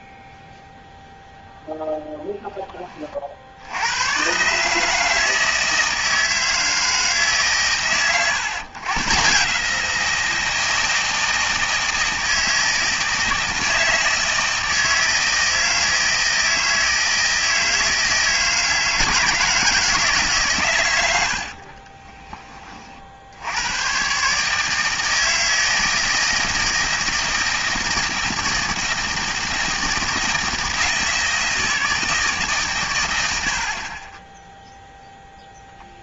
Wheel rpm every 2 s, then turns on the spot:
0, 10, 140, 160, 130, 160, 160, 160, 160, 160, 120, 30, 150, 160, 160, 160, 130, 0.
none